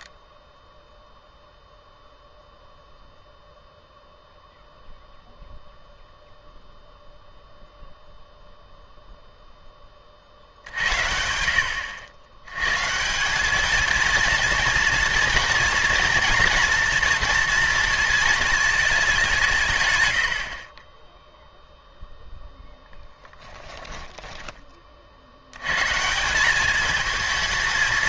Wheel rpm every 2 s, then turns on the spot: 0, 0, 0, 0, 0, 60, 130, 230, 230, 210, 10, 10, 30, 210.
22-24